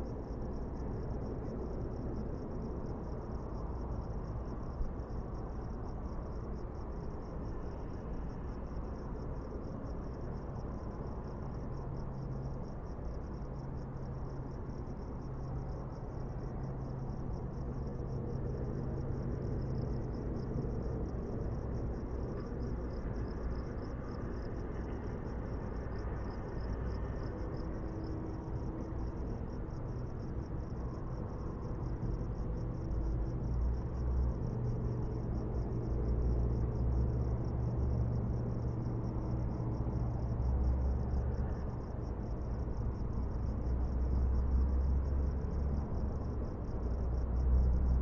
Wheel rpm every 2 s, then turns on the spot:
0, 0, 0, 0, 0, 0, 0, 0, 0, 0, 0, 0, 0, 0, 0, 0, 0, 0, 0, 0, 0, 0, 0, 0.
none